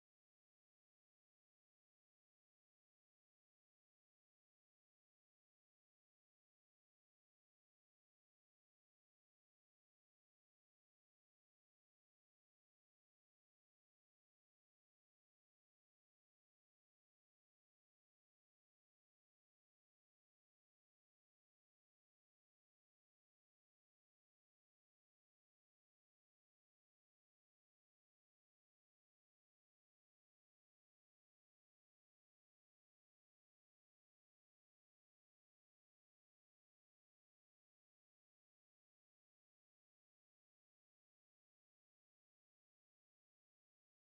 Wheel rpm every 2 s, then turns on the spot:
0, 0, 0, 0, 0, 0, 0, 0, 0, 0, 0, 0, 0, 0, 0, 0, 0, 0, 0, 0, 0, 0.
none